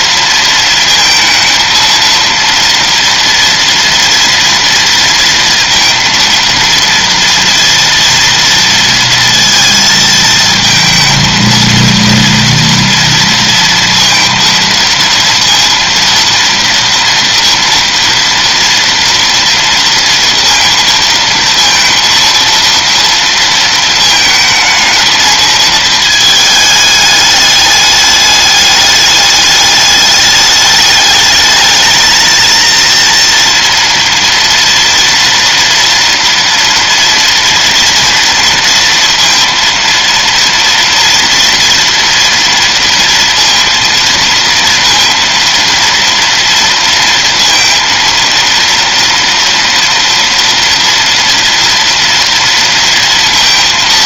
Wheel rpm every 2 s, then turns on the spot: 230, 230, 230, 230, 230, 220, 230, 230, 230, 230, 230, 230, 220, 210, 210, 210, 230, 230, 230, 230, 230, 230, 230, 230, 230, 230, 230.
none